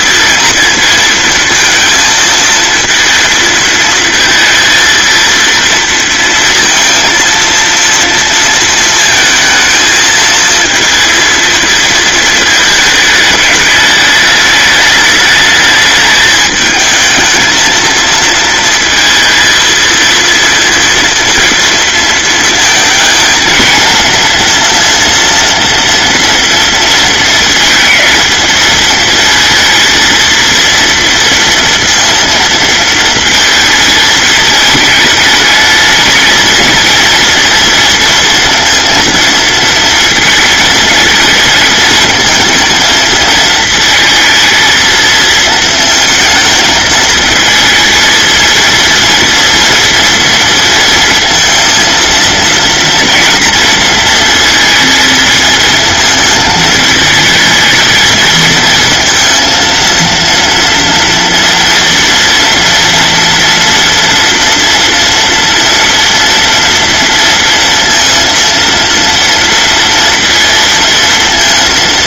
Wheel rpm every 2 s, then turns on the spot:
230, 230, 230, 230, 220, 220, 210, 210, 220, 230, 230, 220, 230, 230, 230, 230, 230, 210, 230, 230, 220, 230, 220, 220, 230, 230, 230, 220, 220, 230, 230, 230, 240, 230, 230, 230.
none